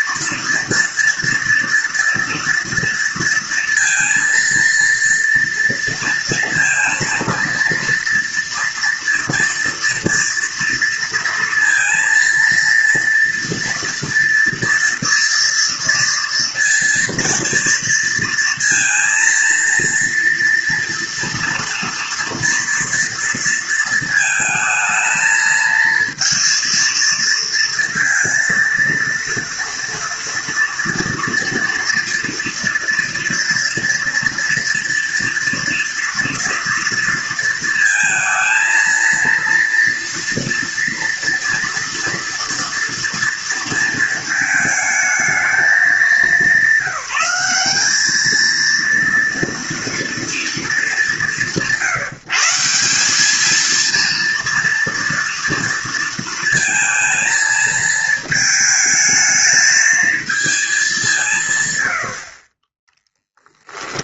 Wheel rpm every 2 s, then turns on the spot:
230, 230, 230, 230, 230, 230, 230, 230, 230, 230, 230, 230, 220, 230, 230, 240, 230, 230, 230, 230, 230, 230, 220, 190, 220, 200, 160, 230, 230, 220, 220, 40.
none